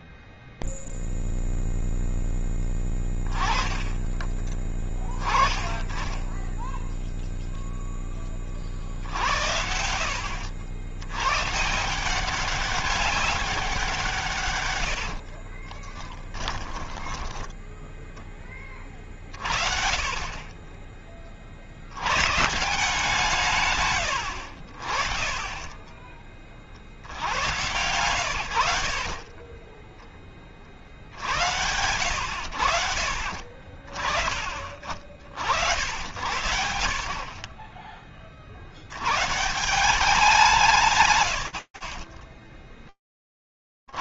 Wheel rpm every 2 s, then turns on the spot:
0, 10, 20, 0, 70, 130, 190, 50, 10, 40, 50, 130, 20, 120, 20, 90, 50, 70, 30, 190, 70, 80.
14-18 24-26 40-42